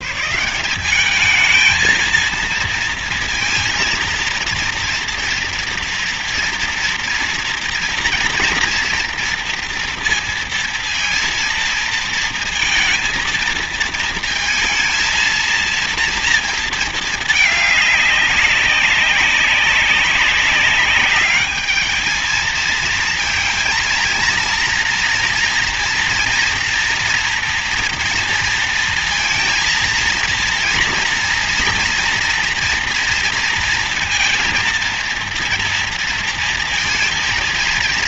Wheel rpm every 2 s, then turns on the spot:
160, 230, 230, 230, 230, 230, 230, 230, 230, 200, 200, 220, 230, 240, 230, 230, 240, 230, 230.
none